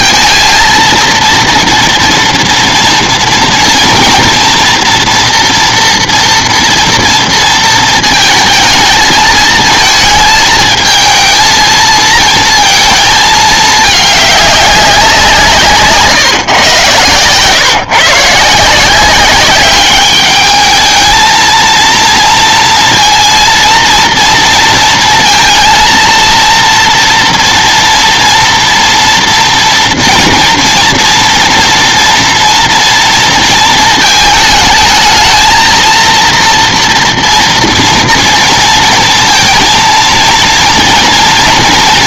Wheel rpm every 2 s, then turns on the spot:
230, 230, 230, 240, 220, 220, 230, 200, 120, 160, 210, 230, 230, 230, 230, 230, 230, 220, 230, 230, 230.
none